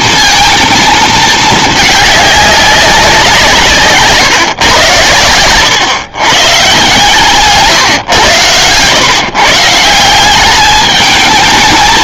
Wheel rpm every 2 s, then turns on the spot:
230, 200, 120, 140, 110, 200.
none